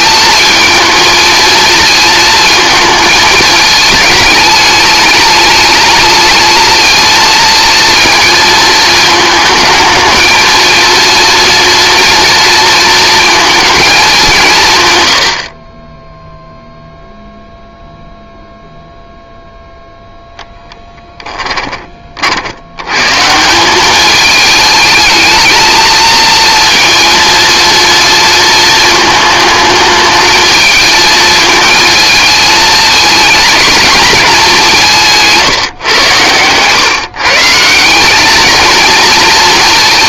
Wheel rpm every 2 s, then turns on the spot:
230, 220, 210, 220, 220, 230, 230, 160, 0, 0, 0, 80, 220, 230, 220, 220, 220, 190, 130, 220.
none